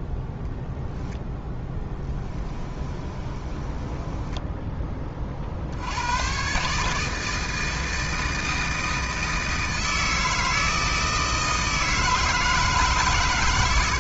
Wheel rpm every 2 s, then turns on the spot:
0, 20, 10, 140, 160, 160, 150.
2-4